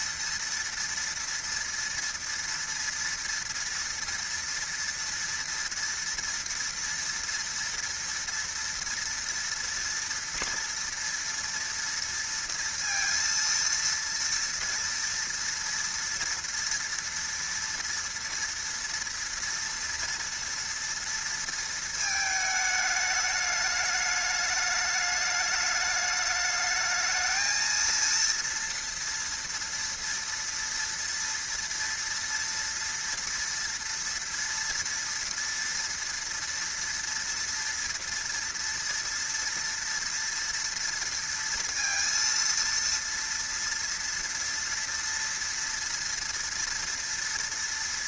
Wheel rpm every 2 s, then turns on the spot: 230, 240, 240, 230, 230, 230, 230, 230, 230, 230, 230, 220, 210, 210, 230, 230, 230, 230, 230, 230, 230, 230, 230, 230.
none